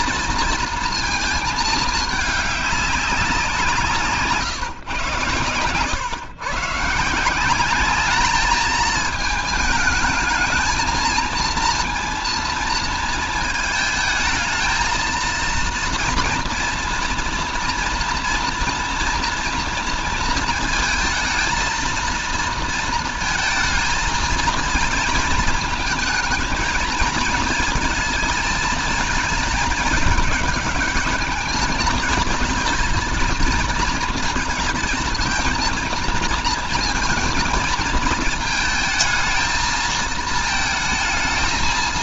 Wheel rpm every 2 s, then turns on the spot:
230, 200, 120, 150, 210, 220, 230, 220, 230, 230, 230, 230, 220, 220, 220, 210, 230, 230, 230, 220, 220.
none